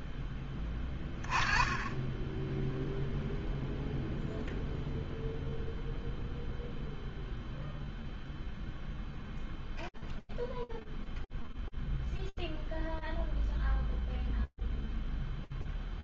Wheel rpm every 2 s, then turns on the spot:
10, 10, 0, 0, 0, 0, 0, 0.
none